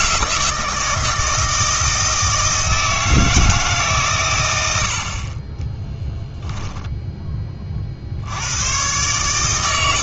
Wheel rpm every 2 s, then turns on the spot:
160, 160, 100, 0, 110.
none